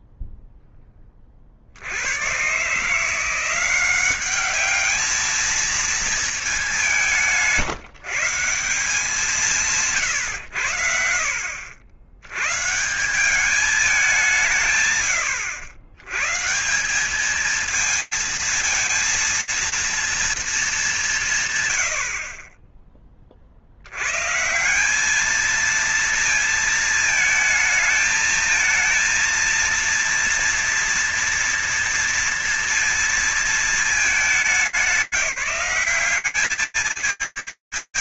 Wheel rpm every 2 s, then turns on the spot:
0, 80, 190, 220, 160, 120, 90, 180, 120, 220, 230, 70, 90, 230, 220, 230, 230, 210, 190.
none